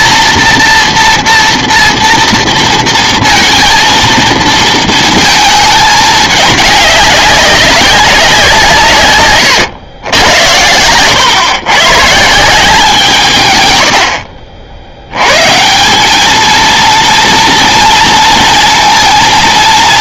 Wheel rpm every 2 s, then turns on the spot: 230, 230, 220, 210, 170, 90, 180, 60, 230, 230.
none